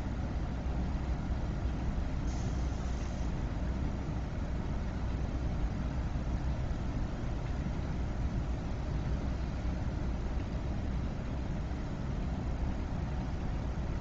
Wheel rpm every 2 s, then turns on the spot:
0, 0, 0, 0, 0, 0, 0.
none